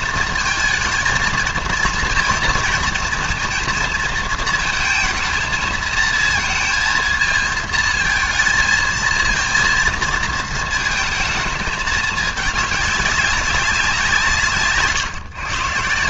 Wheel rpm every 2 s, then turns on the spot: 220, 230, 230, 230, 230, 230, 210, 150.
none